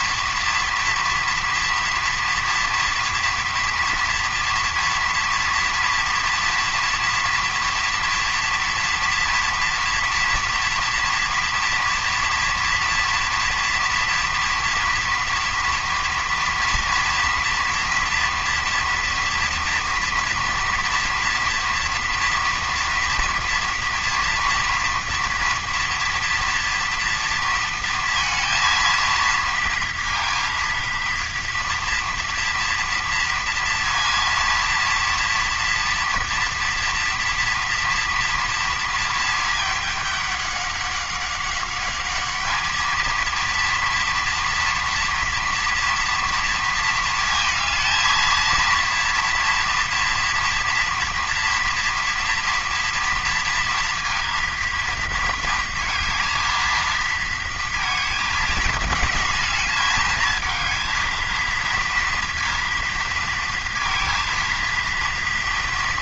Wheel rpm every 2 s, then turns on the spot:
230, 230, 230, 230, 230, 230, 230, 230, 230, 230, 230, 230, 240, 230, 230, 230, 230, 230, 230, 230, 200, 220, 230, 230, 230, 230, 230, 230, 230, 220, 220, 230, 230.
none